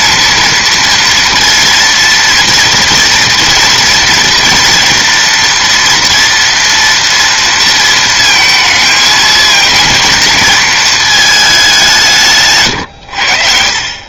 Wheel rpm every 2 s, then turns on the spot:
230, 230, 240, 230, 220, 210, 90.
none